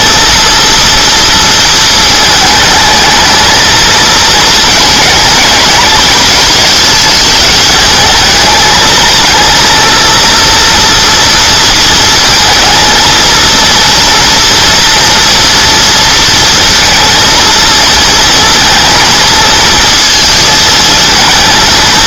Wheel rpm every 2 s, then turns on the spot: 230, 220, 220, 220, 220, 230, 230, 230, 230, 230, 220.
none